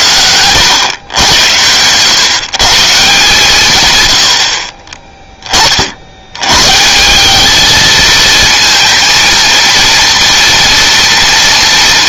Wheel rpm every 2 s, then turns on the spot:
110, 140, 40, 120, 230, 230.
none